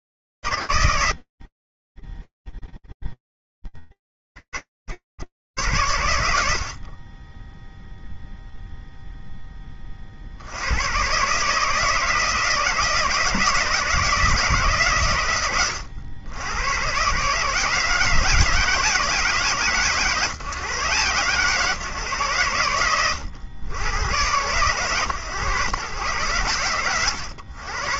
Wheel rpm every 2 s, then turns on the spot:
70, 0, 70, 70, 0, 90, 160, 130, 100, 150, 130, 100, 120, 90.
none